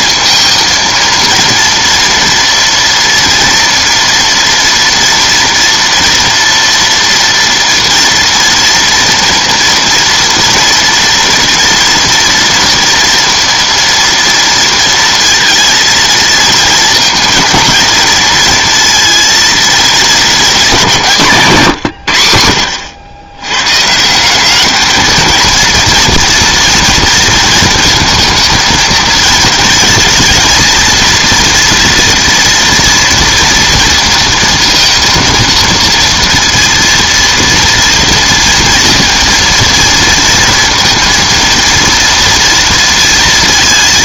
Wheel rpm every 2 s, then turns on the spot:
230, 230, 230, 240, 230, 230, 230, 230, 230, 230, 180, 80, 210, 230, 230, 230, 230, 230, 230, 230, 230, 230.
none